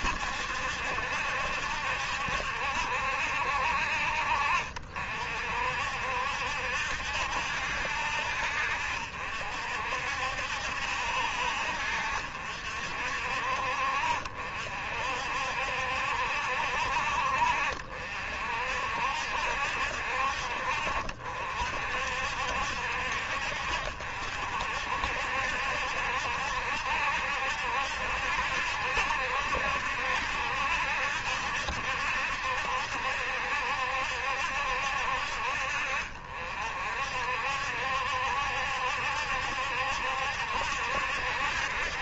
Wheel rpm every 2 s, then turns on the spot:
70, 70, 50, 70, 60, 60, 60, 60, 60, 60, 60, 60, 60, 70, 70, 70, 70, 60, 60, 70, 70.
none